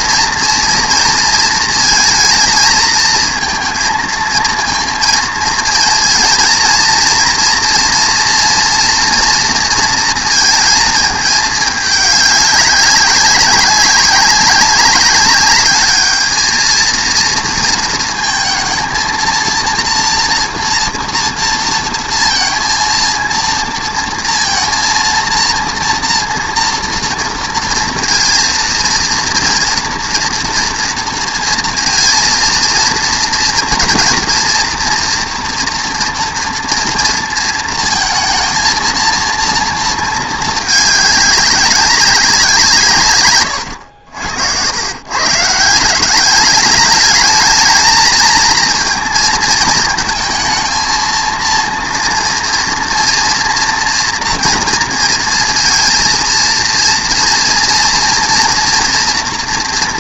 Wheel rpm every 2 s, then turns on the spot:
230, 220, 230, 230, 230, 220, 200, 190, 220, 230, 240, 230, 230, 230, 230, 240, 230, 240, 230, 230, 220, 170, 90, 210, 230, 220, 230, 230, 230, 230.
none